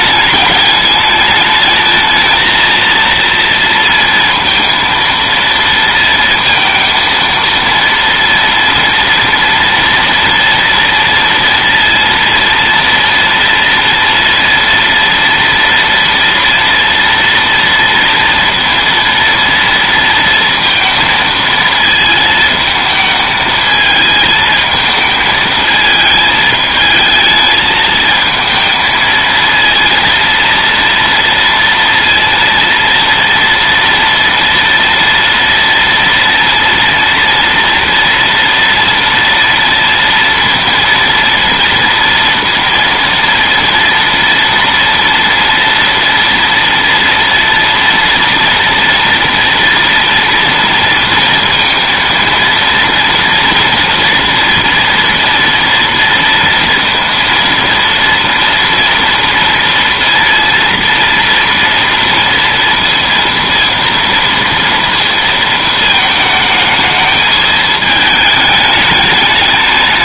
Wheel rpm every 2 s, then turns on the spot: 210, 230, 230, 230, 230, 230, 230, 230, 240, 230, 230, 220, 220, 220, 220, 230, 230, 240, 230, 230, 230, 230, 230, 240, 230, 230, 230, 240, 230, 230, 230, 230, 230, 220, 210.
none